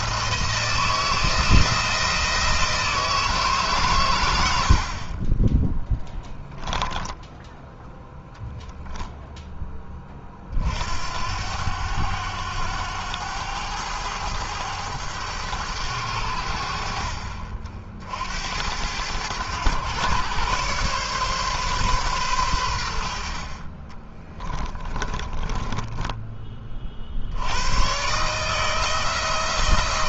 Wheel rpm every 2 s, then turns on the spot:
170, 160, 80, 10, 0, 50, 100, 100, 70, 80, 130, 110, 20, 20, 140.
6-8 24-26